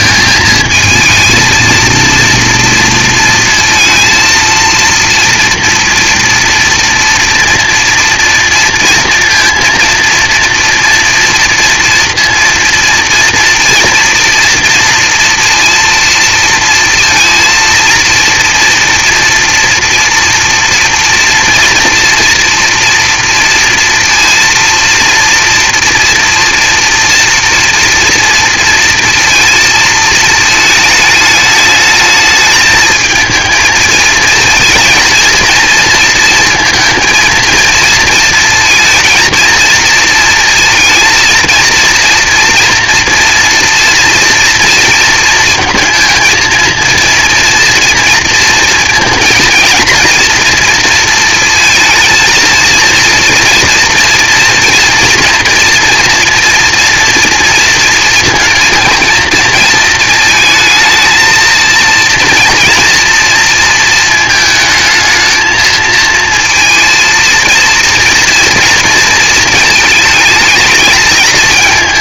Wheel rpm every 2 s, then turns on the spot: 220, 230, 230, 230, 230, 230, 230, 230, 230, 240, 230, 230, 230, 230, 230, 220, 220, 230, 230, 230, 230, 230, 230, 230, 230, 230, 230, 230, 230, 230, 230, 230, 220, 230, 230, 220.
none